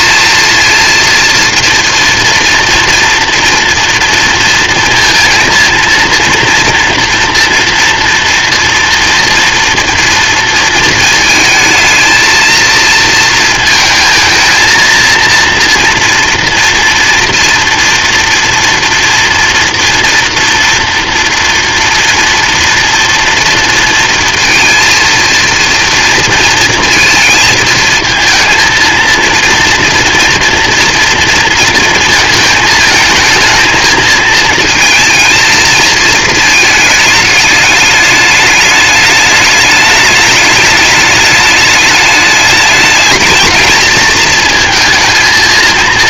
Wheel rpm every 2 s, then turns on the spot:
230, 230, 230, 230, 240, 230, 230, 230, 240, 230, 240, 240, 230, 230, 220, 230, 220, 230, 220, 210, 220, 210, 230.
none